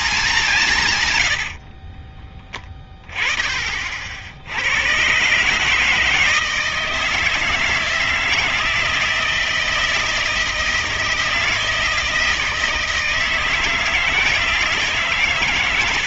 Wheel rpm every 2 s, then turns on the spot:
160, 10, 100, 160, 160, 160, 160, 160.
none